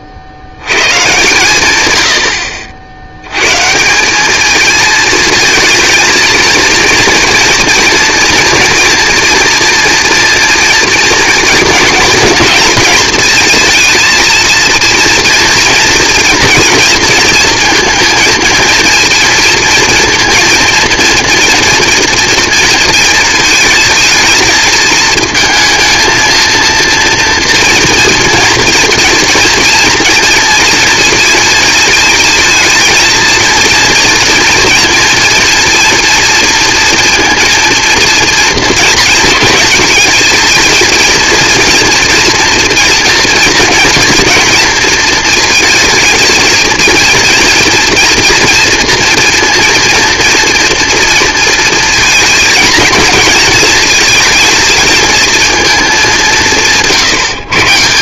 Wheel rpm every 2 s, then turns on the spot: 80, 60, 220, 230, 230, 230, 230, 230, 230, 230, 230, 230, 220, 230, 230, 230, 230, 230, 230, 230, 220, 230, 230, 230, 230, 230, 220, 220, 170.
none